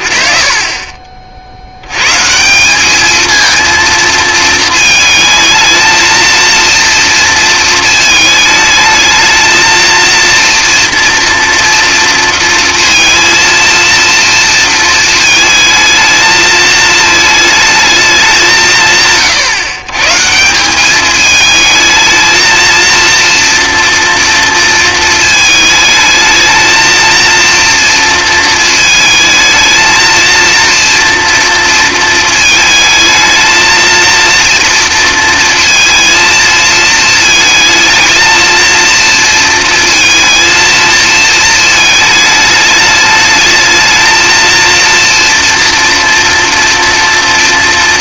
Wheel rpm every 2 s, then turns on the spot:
30, 200, 220, 230, 220, 230, 230, 220, 220, 160, 200, 230, 230, 220, 220, 230, 220, 230, 230, 230, 230, 210, 230, 230.
none